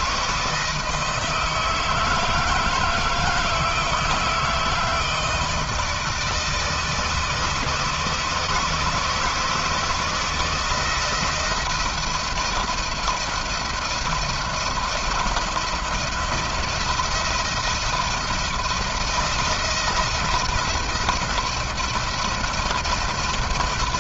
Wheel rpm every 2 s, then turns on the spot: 160, 160, 170, 160, 160, 160, 170, 170, 170, 170, 170, 170.
none